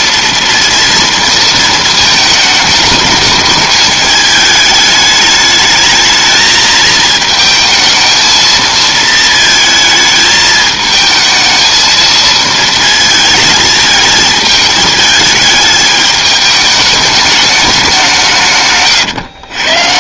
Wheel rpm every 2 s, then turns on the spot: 230, 210, 210, 220, 220, 220, 220, 220, 210, 150.
18-20